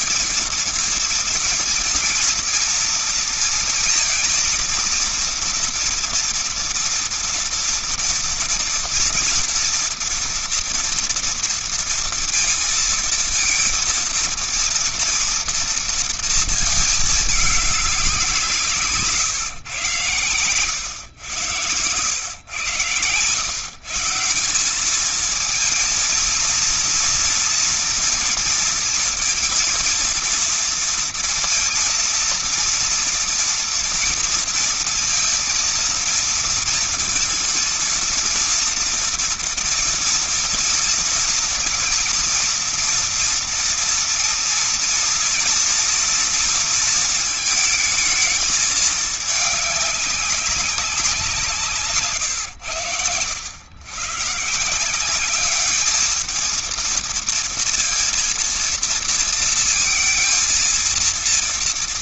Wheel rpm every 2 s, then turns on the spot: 230, 230, 230, 230, 230, 230, 230, 230, 230, 170, 110, 100, 170, 230, 230, 230, 230, 230, 230, 230, 230, 220, 230, 230, 220, 200, 120, 150, 220, 230, 230.
none